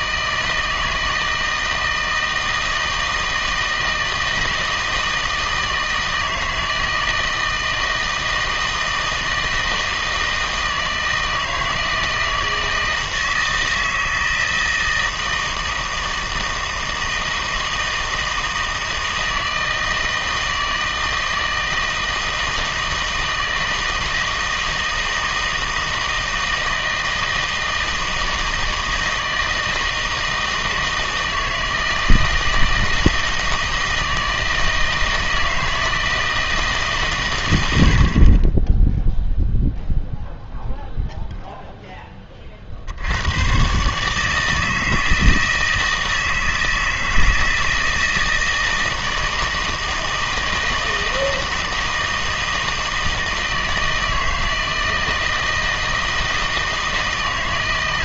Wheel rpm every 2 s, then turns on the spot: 160, 160, 160, 160, 160, 160, 160, 160, 160, 160, 160, 160, 160, 160, 160, 160, 160, 160, 150, 10, 0, 60, 160, 160, 160, 160, 160, 160, 160.
none